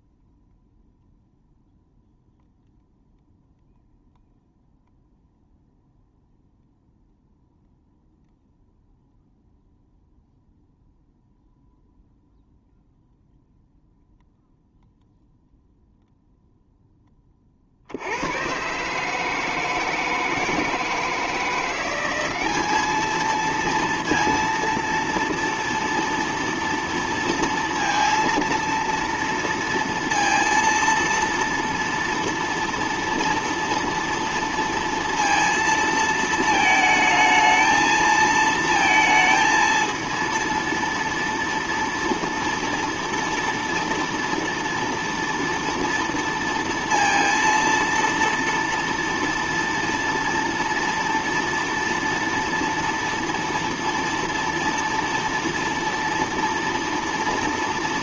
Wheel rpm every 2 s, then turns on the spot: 0, 0, 0, 0, 0, 0, 0, 0, 0, 120, 160, 200, 230, 230, 230, 230, 230, 230, 220, 220, 230, 240, 230, 230, 230, 230, 230, 230, 230.
none